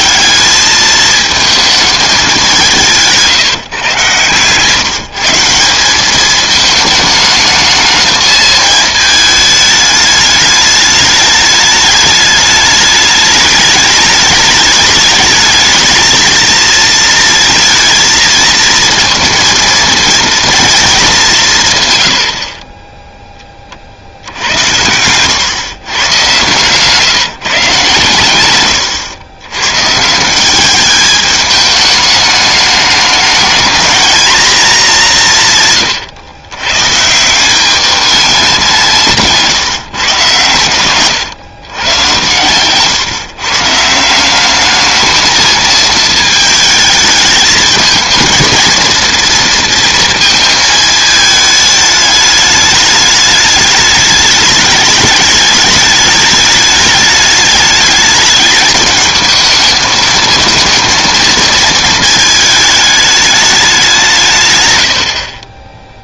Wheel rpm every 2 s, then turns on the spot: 210, 180, 150, 220, 220, 210, 210, 210, 230, 230, 230, 30, 90, 140, 110, 190, 200, 210, 130, 190, 120, 120, 200, 220, 220, 220, 210, 210, 210, 210, 220, 220, 110.
none